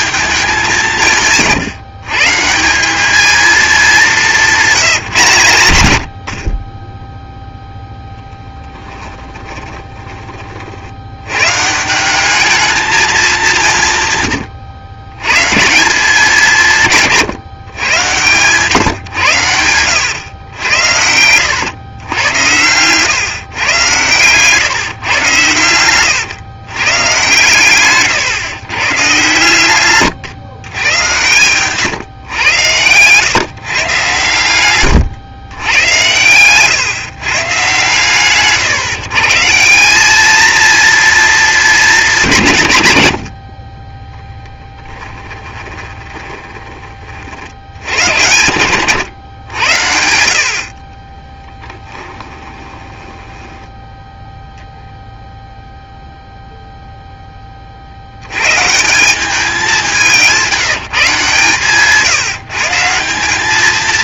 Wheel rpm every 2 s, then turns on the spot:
190, 170, 190, 30, 10, 60, 210, 110, 170, 130, 90, 100, 130, 130, 130, 110, 110, 130, 120, 140, 230, 140, 10, 20, 110, 50, 20, 0, 0, 140, 180, 150.
8-10 14-16 18-20 22-24 44-46 52-54